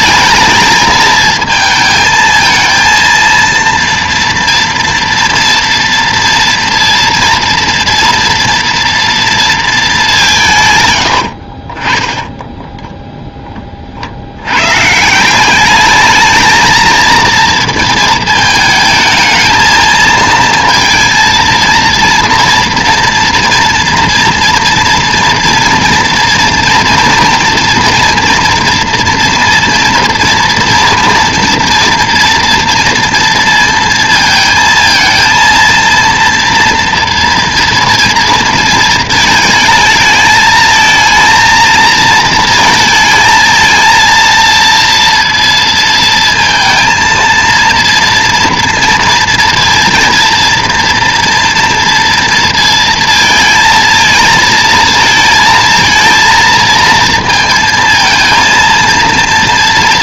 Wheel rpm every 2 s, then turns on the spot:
220, 230, 230, 230, 230, 140, 10, 110, 220, 220, 230, 230, 230, 230, 230, 230, 230, 220, 230, 230, 220, 230, 230, 230, 230, 230, 230, 220, 230, 230.
none